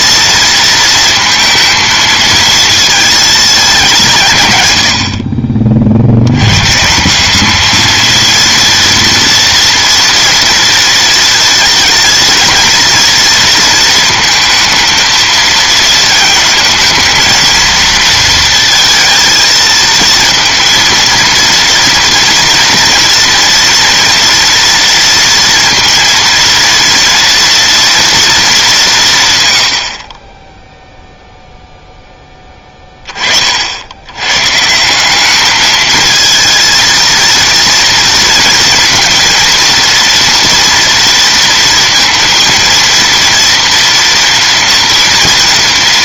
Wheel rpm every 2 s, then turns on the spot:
230, 220, 120, 120, 230, 230, 230, 230, 220, 230, 230, 230, 230, 230, 210, 10, 20, 140, 230, 230, 230, 230, 240.
30-32